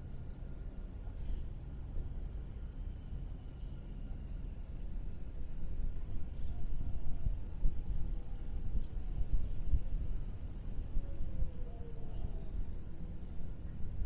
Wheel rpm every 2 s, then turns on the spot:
0, 0, 0, 0, 0, 0, 0.
none